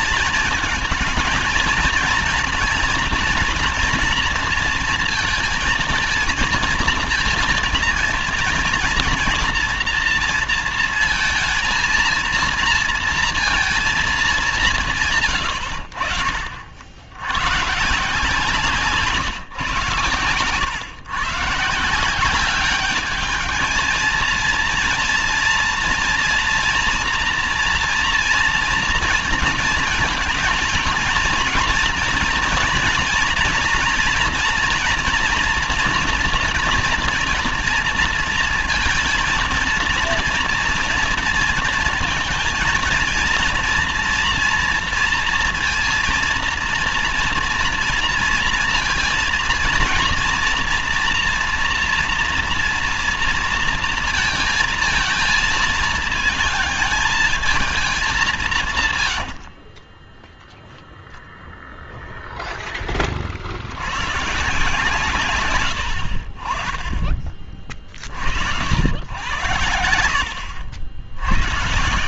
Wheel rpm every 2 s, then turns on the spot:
220, 230, 230, 230, 230, 230, 230, 190, 60, 160, 110, 190, 230, 230, 230, 230, 230, 230, 240, 230, 230, 230, 230, 230, 230, 230, 240, 230, 220, 160, 0, 0, 140, 50, 80, 80.
none